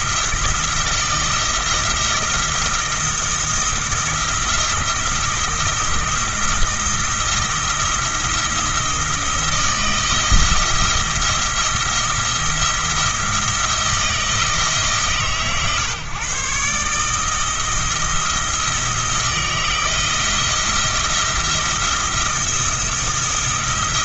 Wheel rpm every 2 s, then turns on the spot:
160, 170, 170, 160, 170, 170, 170, 150, 150, 160, 170, 170.
none